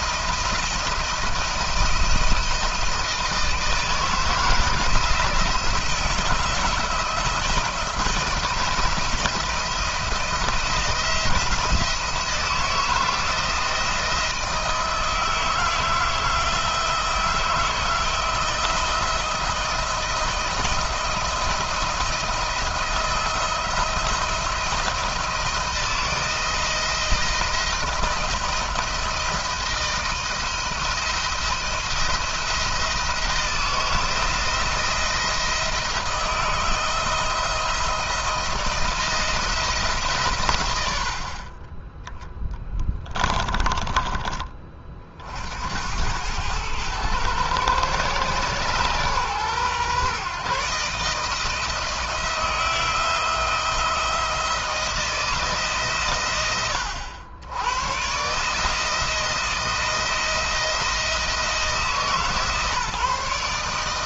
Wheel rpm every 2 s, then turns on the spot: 170, 160, 160, 160, 170, 160, 170, 160, 160, 160, 160, 170, 160, 170, 170, 160, 160, 160, 160, 170, 90, 20, 50, 100, 120, 140, 170, 160, 80, 160, 170, 150.
42-44